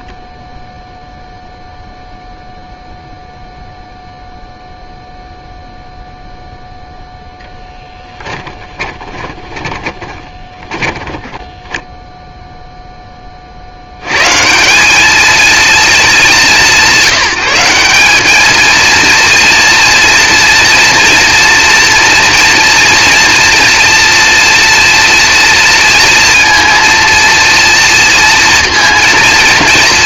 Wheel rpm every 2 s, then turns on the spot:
0, 0, 0, 10, 30, 0, 120, 210, 200, 230, 230, 230, 230, 230, 230.
6-10